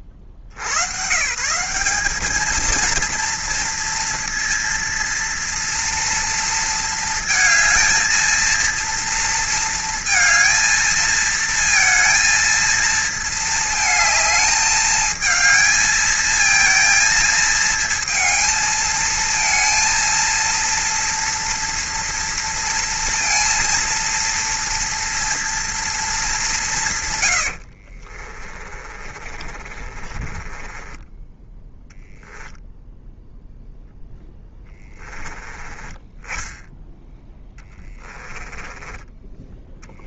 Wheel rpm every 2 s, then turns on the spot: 60, 220, 230, 230, 230, 220, 230, 220, 230, 230, 230, 230, 230, 170, 30, 20, 0, 10, 10, 20.
28-32 38-40